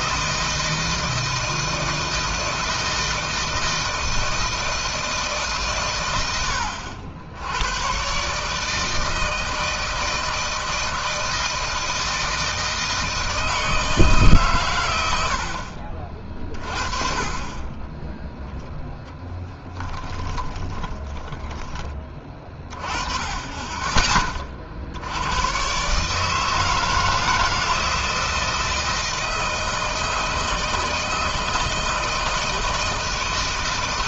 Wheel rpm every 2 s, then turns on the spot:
160, 160, 160, 90, 150, 160, 160, 120, 40, 10, 20, 20, 40, 160, 160, 160, 160.
20-22